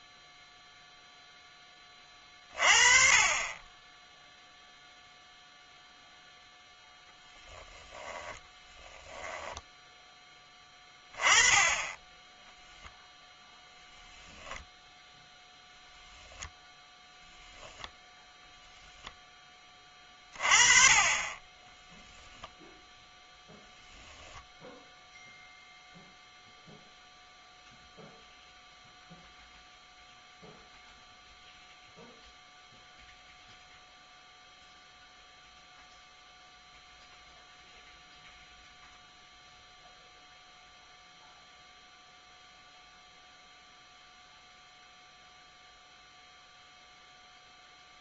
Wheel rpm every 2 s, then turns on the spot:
0, 40, 0, 10, 10, 10, 0, 0, 0, 20, 30, 0, 0, 0, 0, 0, 0, 0, 0, 0, 0, 0, 0, 0.
8-10 18-20